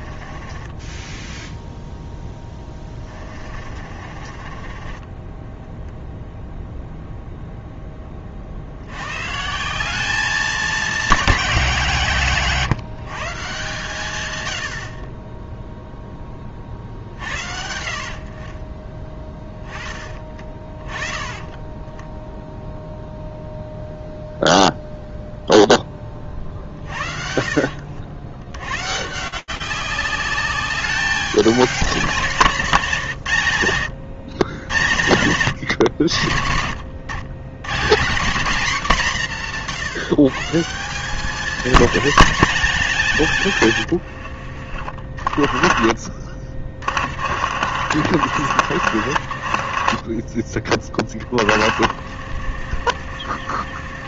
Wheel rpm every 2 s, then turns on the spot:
20, 20, 30, 0, 70, 200, 150, 70, 50, 30, 20, 0, 0, 50, 110, 200, 170, 100, 100, 210, 160, 210, 60, 40, 70, 20, 70.
0-6 26-28 46-50 52-54